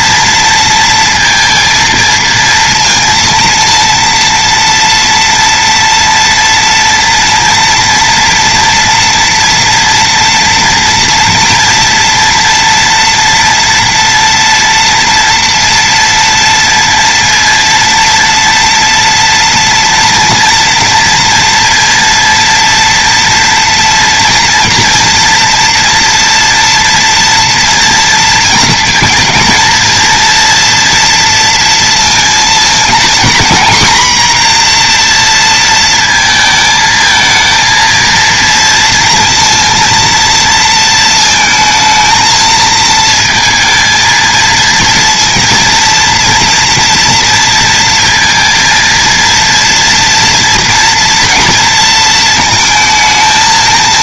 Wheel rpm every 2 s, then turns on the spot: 230, 230, 230, 230, 240, 230, 230, 230, 230, 230, 230, 240, 230, 230, 230, 230, 230, 240, 220, 230, 230, 220, 230, 230, 230, 230, 220.
none